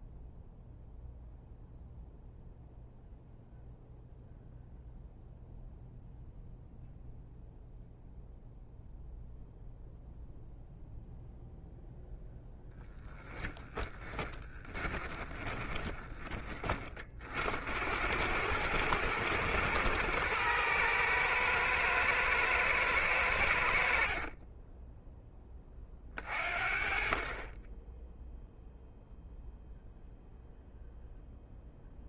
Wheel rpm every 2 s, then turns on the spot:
0, 0, 0, 0, 0, 0, 10, 30, 40, 110, 110, 100, 10, 40, 0, 0.
12-16 24-26